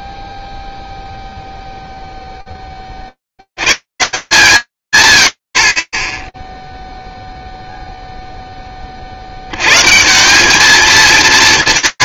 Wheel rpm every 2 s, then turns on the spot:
0, 70, 90, 0, 80, 230.
none